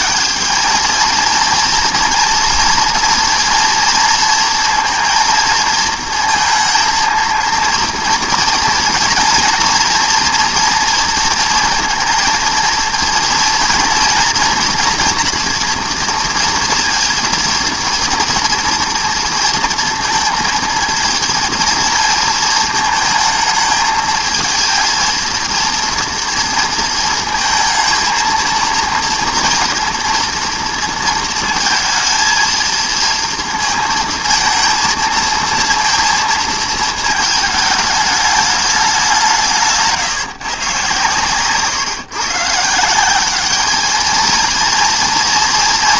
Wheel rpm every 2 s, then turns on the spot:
210, 230, 230, 230, 230, 230, 230, 240, 240, 230, 230, 230, 220, 230, 230, 230, 230, 230, 220, 210, 160, 140, 220.
none